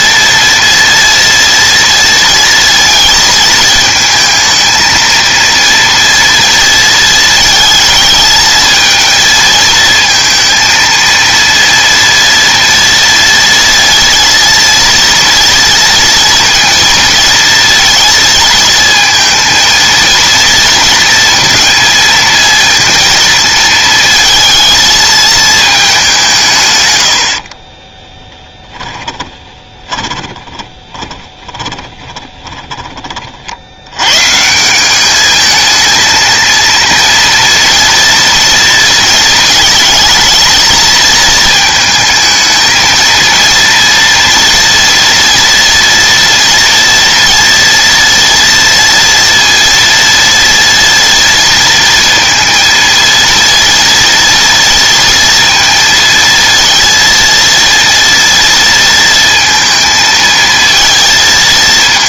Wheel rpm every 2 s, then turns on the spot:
230, 230, 220, 230, 220, 230, 230, 230, 230, 230, 230, 220, 220, 140, 10, 20, 10, 160, 220, 230, 220, 220, 230, 240, 240, 230, 230, 230, 230, 230, 220.
28-34